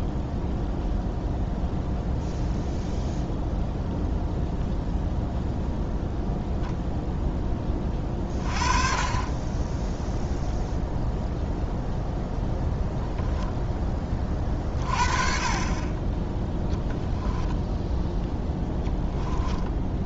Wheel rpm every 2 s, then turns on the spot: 0, 0, 0, 0, 30, 0, 0, 40, 0, 10.
18-20